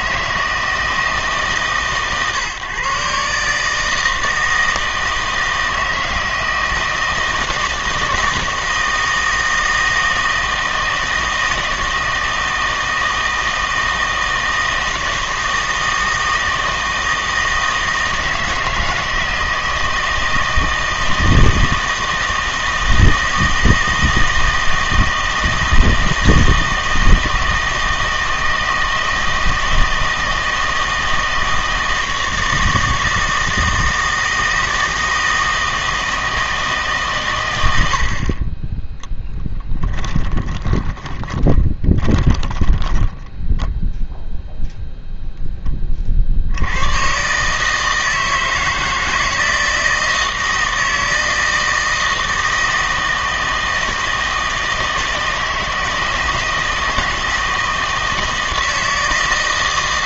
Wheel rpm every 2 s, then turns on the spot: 160, 140, 160, 160, 160, 160, 160, 160, 160, 160, 160, 160, 160, 160, 160, 160, 160, 160, 160, 20, 20, 10, 0, 90, 160, 160, 160, 160, 160, 160.
40-44